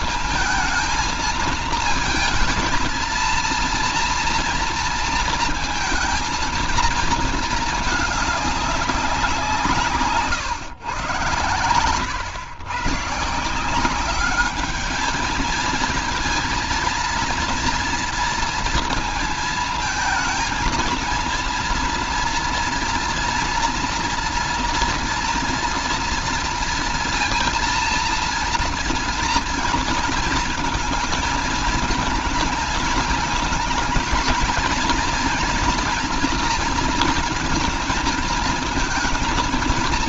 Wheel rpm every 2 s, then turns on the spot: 230, 220, 230, 230, 200, 140, 120, 200, 220, 230, 230, 230, 240, 230, 230, 220, 220, 220, 230, 230.
none